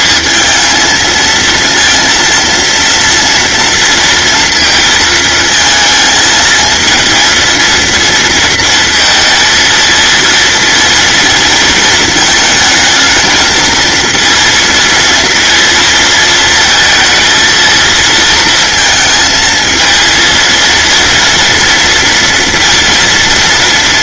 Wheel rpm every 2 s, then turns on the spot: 230, 240, 230, 230, 230, 230, 220, 230, 230, 220, 230, 230.
none